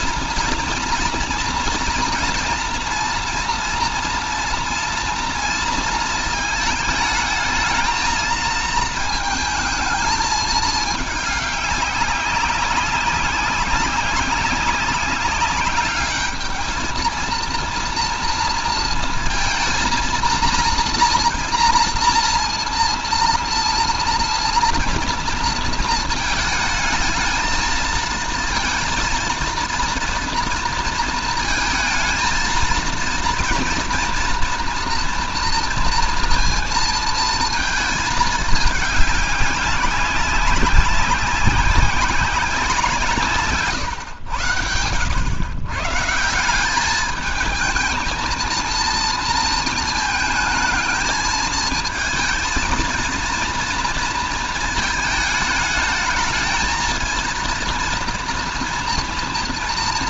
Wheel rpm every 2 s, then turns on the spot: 230, 230, 230, 220, 220, 220, 190, 190, 210, 230, 240, 230, 230, 220, 230, 230, 230, 240, 230, 220, 190, 180, 90, 170, 230, 220, 220, 220, 220, 230.
none